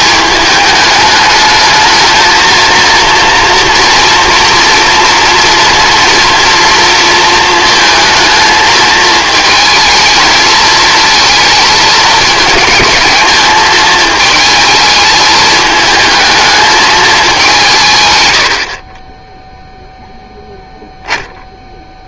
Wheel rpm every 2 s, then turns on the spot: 210, 230, 230, 230, 220, 220, 220, 220, 220, 60, 0.
18-20